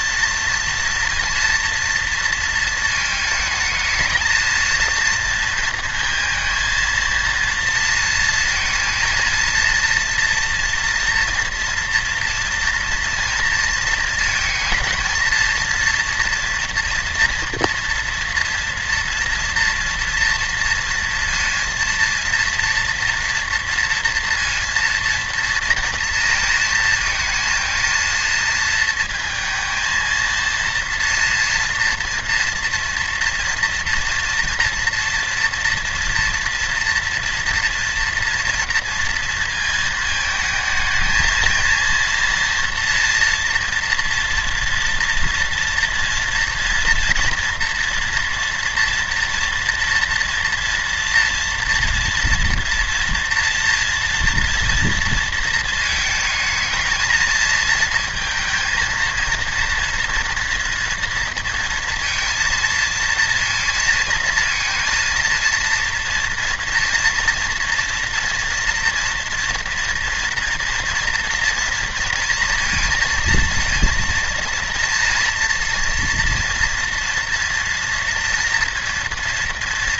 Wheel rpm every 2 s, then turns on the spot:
230, 230, 220, 230, 230, 230, 230, 230, 230, 230, 230, 230, 230, 230, 230, 230, 230, 230, 230, 230, 220, 230, 230, 240, 240, 230, 230, 230, 220, 230, 230, 230, 230, 240, 230, 230, 230, 230, 230, 230.
none